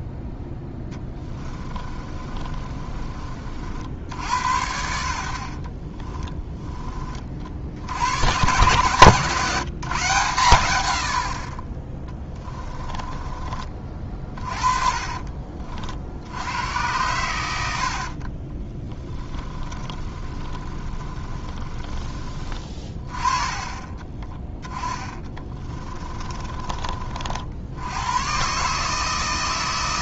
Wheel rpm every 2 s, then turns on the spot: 10, 30, 80, 20, 140, 110, 20, 30, 100, 20, 30, 30, 10, 40, 150.
0-6 12-16 18-22 24-26